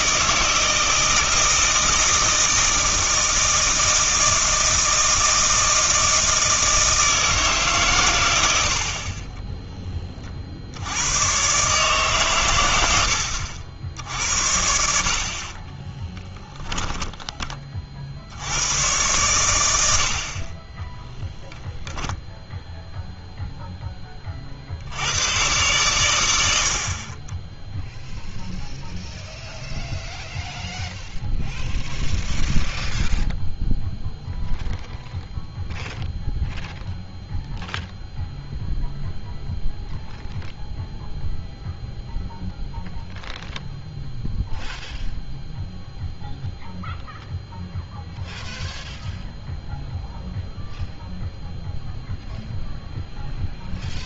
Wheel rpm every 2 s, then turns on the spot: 160, 160, 160, 160, 70, 70, 90, 60, 10, 100, 20, 0, 70, 60, 0, 0, 0, 0, 0, 0, 0, 0, 0, 0, 0, 0, 0.
16-18